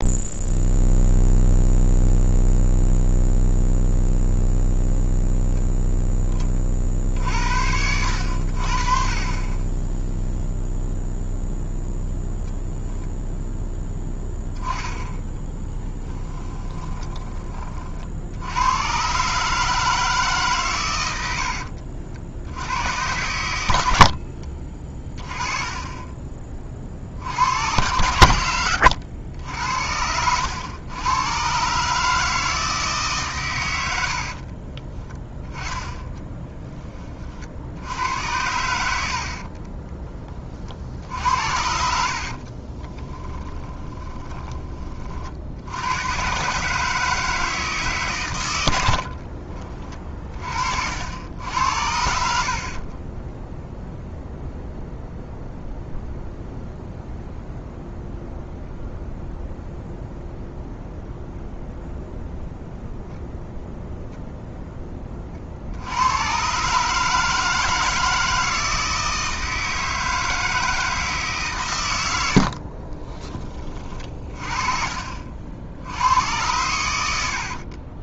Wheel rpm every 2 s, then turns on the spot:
0, 0, 0, 50, 40, 0, 0, 10, 20, 110, 130, 100, 30, 40, 80, 100, 150, 30, 20, 80, 60, 20, 20, 150, 70, 60, 40, 0, 0, 0, 0, 0, 10, 140, 160, 160, 40, 40, 100.
14-18 34-36 42-44 52-54 72-76